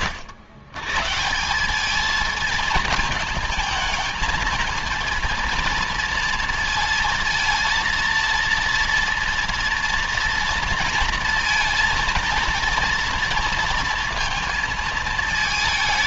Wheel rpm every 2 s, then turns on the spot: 120, 220, 220, 230, 230, 230, 230, 230.
none